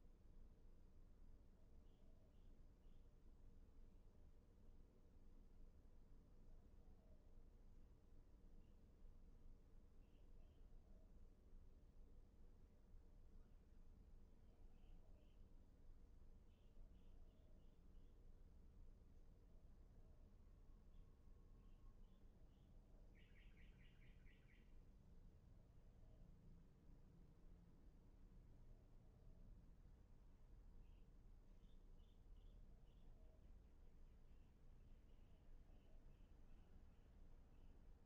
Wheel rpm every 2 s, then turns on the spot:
0, 0, 0, 0, 0, 0, 0, 0, 0, 0, 0, 0, 0, 0, 0, 0, 0, 0, 0.
none